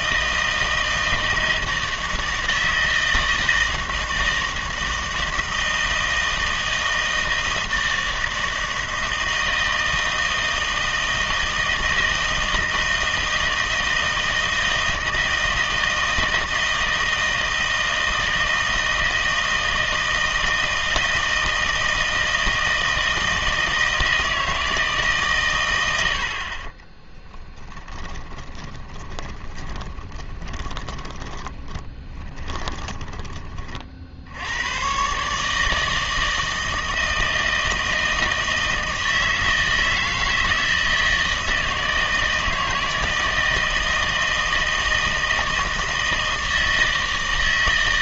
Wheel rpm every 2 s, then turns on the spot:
160, 160, 160, 160, 160, 160, 160, 160, 160, 160, 160, 160, 160, 50, 20, 20, 20, 100, 160, 160, 160, 160, 160, 160.
28-34